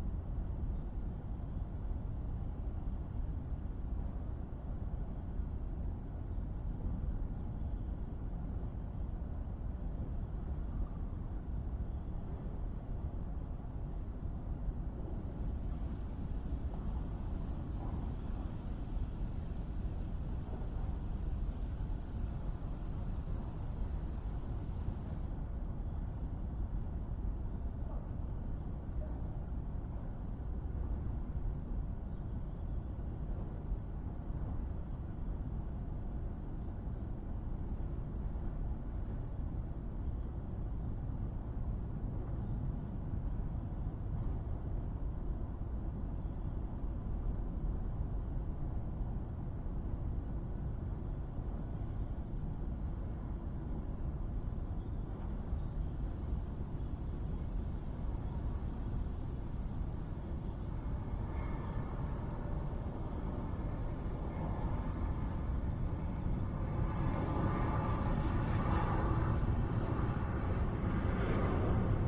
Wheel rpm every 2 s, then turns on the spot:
0, 0, 0, 0, 0, 0, 0, 0, 0, 0, 0, 0, 0, 0, 0, 0, 0, 0, 0, 0, 0, 0, 0, 0, 0, 0, 0, 0, 0, 0, 0, 0, 0, 0, 0, 0.
none